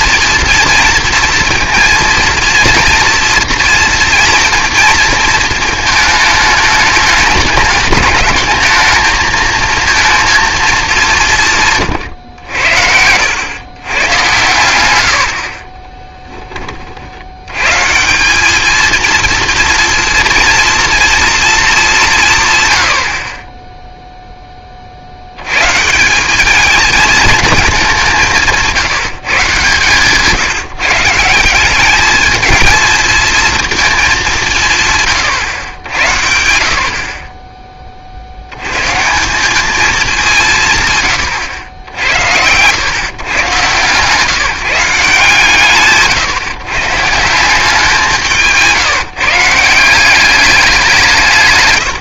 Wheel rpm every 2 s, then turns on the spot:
230, 230, 230, 210, 220, 230, 90, 90, 30, 220, 230, 130, 10, 200, 170, 160, 220, 160, 70, 110, 150, 90, 160, 140, 170, 180.
48-50